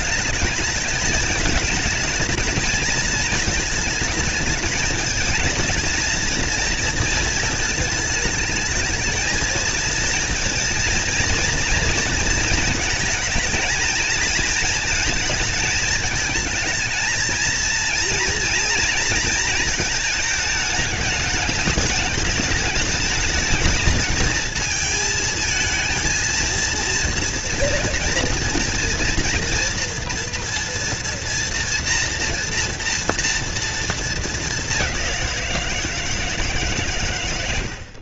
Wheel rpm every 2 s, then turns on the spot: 220, 220, 220, 230, 220, 230, 220, 220, 220, 230, 210, 210, 220, 230, 230, 230, 230, 200, 120.
none